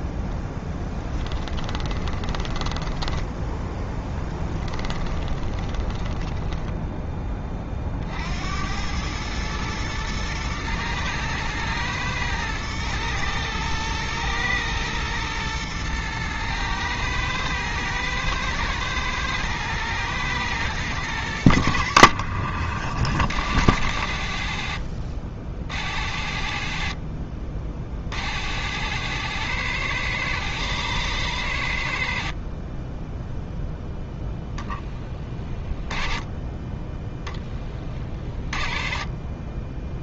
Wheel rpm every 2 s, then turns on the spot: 10, 10, 10, 10, 70, 120, 110, 110, 120, 110, 110, 40, 60, 50, 80, 100, 30, 10, 20, 30.
0-8